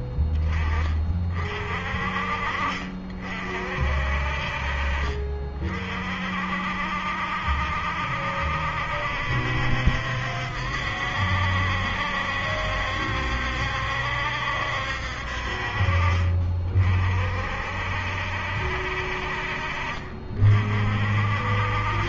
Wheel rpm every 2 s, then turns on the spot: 20, 50, 40, 60, 70, 70, 70, 60, 40, 60, 40.
none